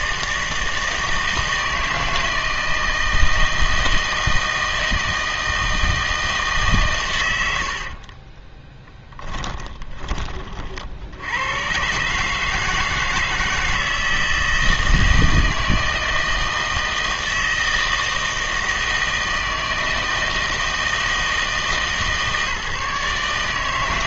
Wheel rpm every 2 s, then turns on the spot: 160, 160, 160, 140, 10, 50, 160, 160, 160, 160, 160, 150.
8-10